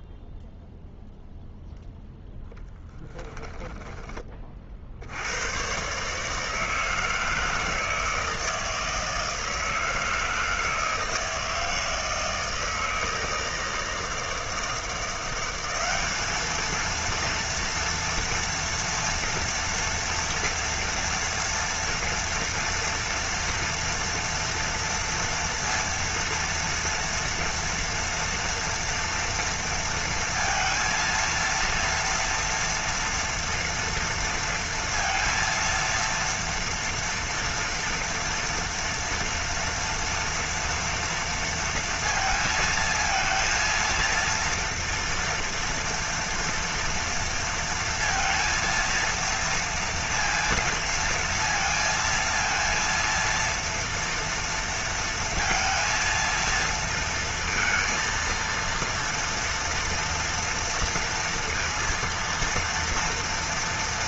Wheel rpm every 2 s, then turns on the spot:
0, 10, 40, 160, 160, 160, 160, 160, 220, 230, 230, 240, 230, 230, 230, 230, 230, 230, 230, 230, 230, 220, 230, 230, 230, 230, 230, 230, 230, 230, 230, 230.
2-4